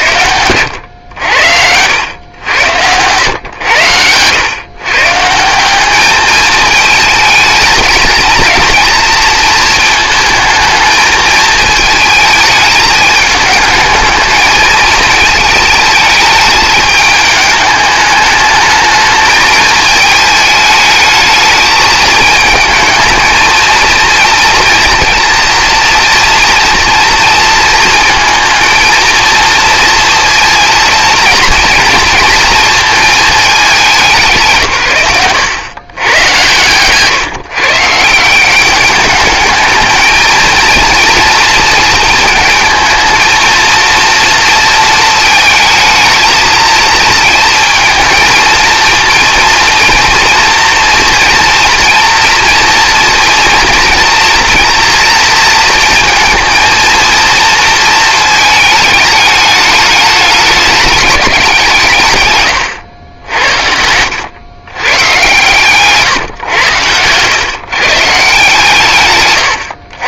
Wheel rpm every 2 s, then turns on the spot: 100, 100, 120, 220, 230, 220, 220, 220, 210, 210, 220, 220, 230, 230, 230, 220, 220, 140, 130, 180, 230, 220, 230, 220, 220, 230, 230, 240, 230, 220, 210, 110, 120, 110, 140.
2-4 36-38 62-64 66-68